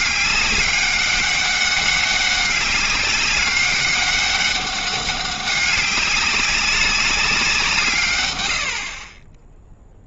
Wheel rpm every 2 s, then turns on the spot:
200, 200, 200, 200, 80.
8-10